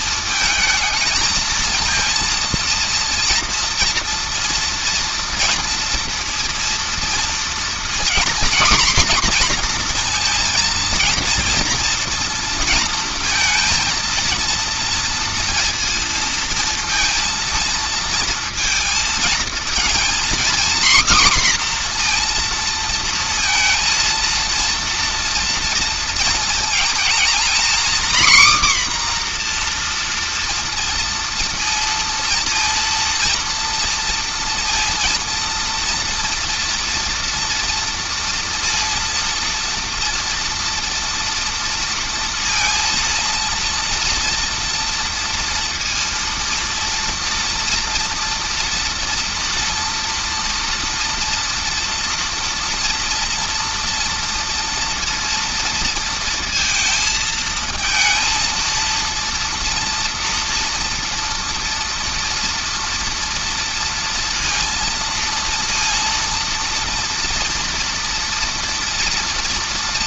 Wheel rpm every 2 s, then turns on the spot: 220, 230, 230, 240, 250, 230, 230, 230, 230, 230, 250, 230, 230, 230, 260, 230, 230, 230, 230, 230, 230, 230, 230, 230, 230, 230, 230, 230, 220, 230, 230, 230, 230, 230, 230.
none